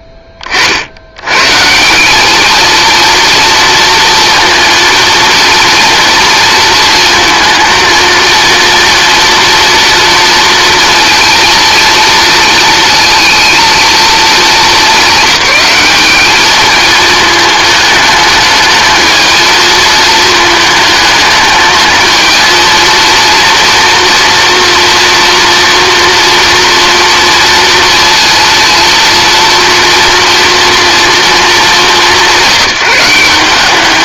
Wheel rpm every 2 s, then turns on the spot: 40, 220, 230, 230, 230, 230, 230, 200, 220, 220, 220, 230, 230, 230, 230, 240, 170.
none